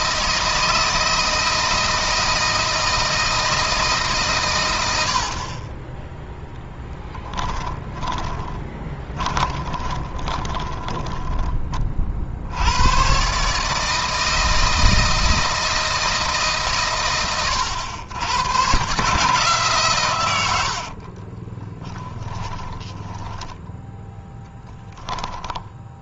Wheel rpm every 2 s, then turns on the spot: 160, 160, 100, 10, 20, 20, 100, 160, 140, 130, 80, 10, 10.
8-12 20-26